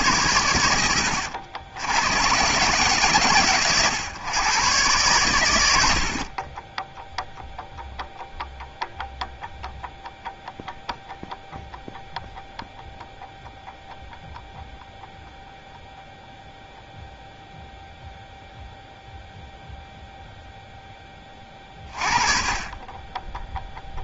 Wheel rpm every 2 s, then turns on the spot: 90, 120, 120, 20, 0, 0, 0, 0, 0, 0, 0, 20.
none